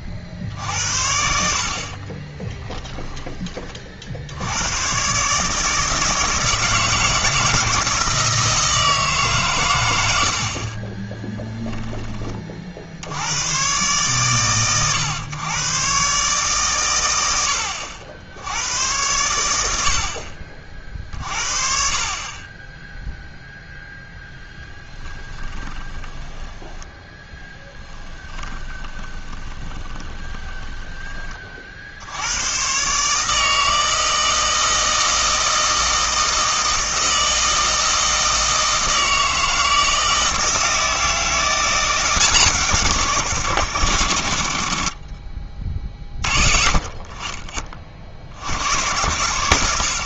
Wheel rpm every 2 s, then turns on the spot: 70, 10, 100, 160, 160, 30, 50, 120, 130, 100, 60, 20, 10, 10, 20, 20, 130, 160, 160, 160, 160, 160, 50, 40, 80.
2-4 10-12 24-32